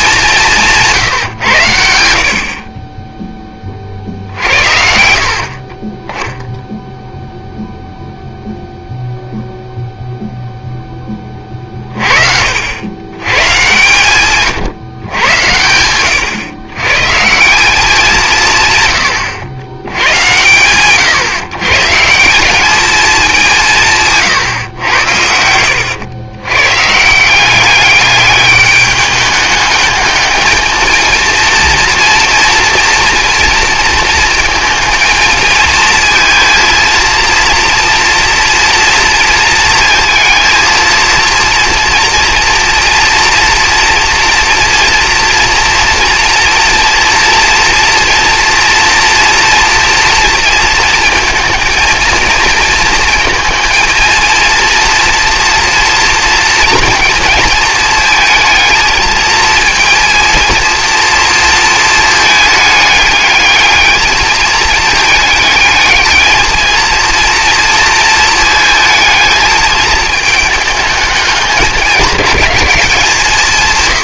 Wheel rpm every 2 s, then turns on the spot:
180, 60, 60, 0, 0, 0, 70, 130, 120, 140, 120, 190, 120, 130, 210, 220, 230, 230, 230, 230, 230, 230, 240, 230, 240, 230, 230, 230, 230, 220, 230, 210, 220, 220, 220, 220, 190.
none